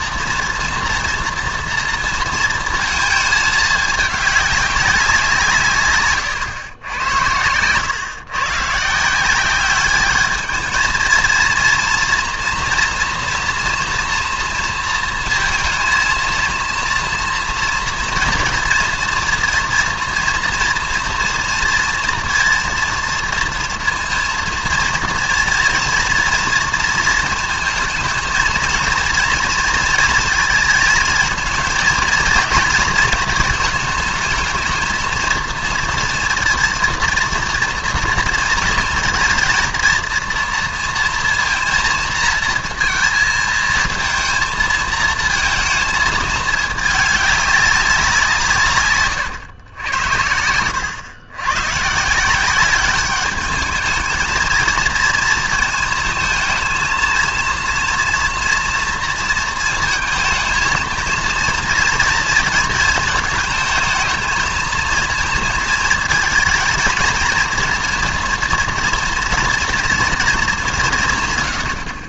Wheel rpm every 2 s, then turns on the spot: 230, 230, 200, 120, 140, 220, 230, 230, 230, 240, 230, 230, 230, 230, 220, 220, 220, 220, 230, 230, 230, 230, 220, 210, 150, 90, 190, 230, 220, 240, 220, 220, 220, 220, 230, 200.
none